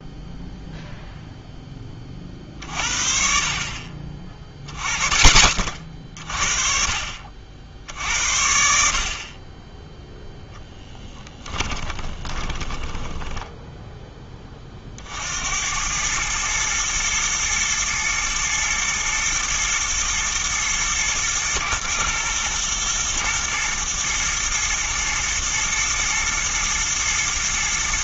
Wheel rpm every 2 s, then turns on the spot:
0, 50, 30, 40, 60, 0, 20, 40, 110, 110, 120, 120, 120, 110.
12-14